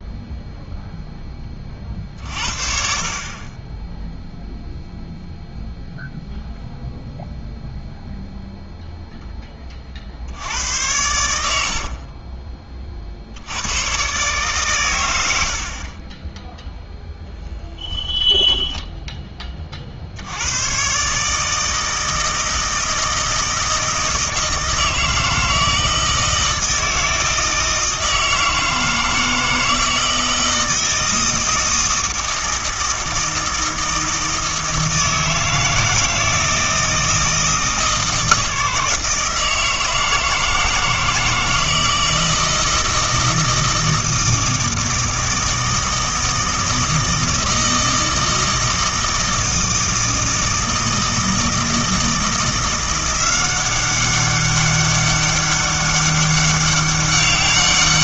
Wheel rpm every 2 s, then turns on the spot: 0, 50, 0, 0, 0, 90, 40, 120, 0, 10, 120, 160, 160, 160, 160, 160, 160, 160, 160, 160, 160, 160, 160, 160, 160, 160, 170, 200, 200.
18-20